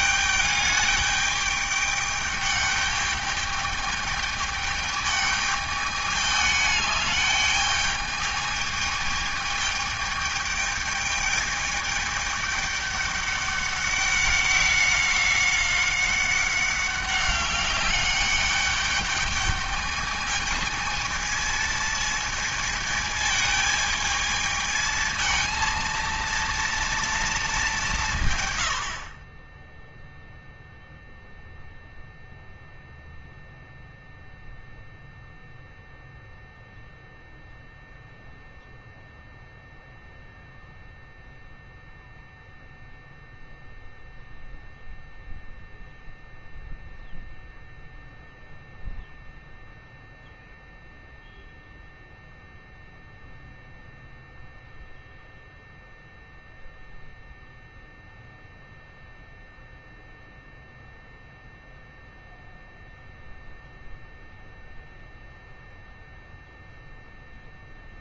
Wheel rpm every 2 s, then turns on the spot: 210, 210, 210, 210, 210, 210, 210, 190, 190, 200, 220, 220, 220, 230, 70, 0, 0, 0, 0, 0, 0, 0, 0, 0, 0, 0, 0, 0, 0, 0, 0, 0, 0, 0.
none